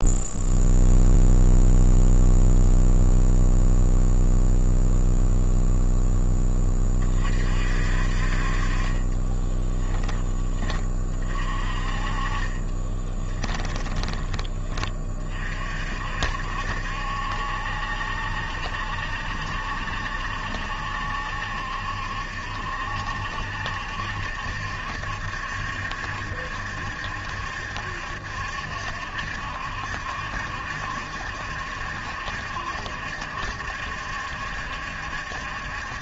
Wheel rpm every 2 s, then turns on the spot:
0, 0, 0, 30, 30, 30, 20, 30, 70, 70, 70, 60, 70, 70, 70, 70, 70, 70.
8-10 12-14